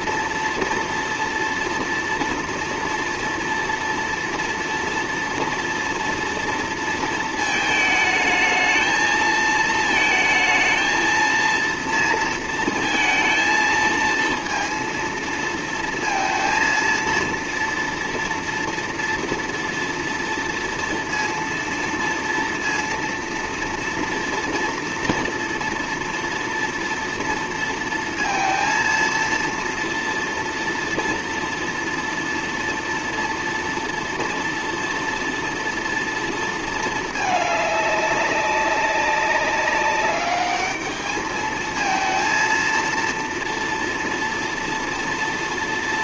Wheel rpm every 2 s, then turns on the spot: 230, 230, 230, 230, 220, 230, 230, 230, 230, 230, 230, 230, 230, 230, 230, 230, 230, 230, 220, 200, 210, 230, 230.
none